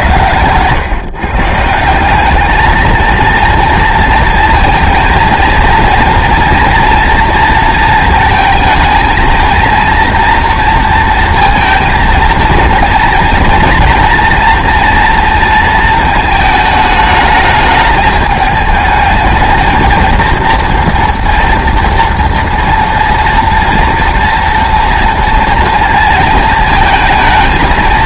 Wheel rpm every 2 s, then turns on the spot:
120, 220, 220, 230, 220, 230, 230, 230, 220, 210, 230, 230, 230, 230.
none